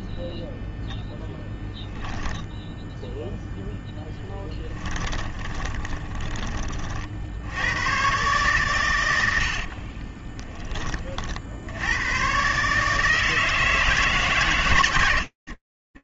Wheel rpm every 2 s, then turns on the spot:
0, 0, 10, 40, 130, 20, 140, 120.
4-6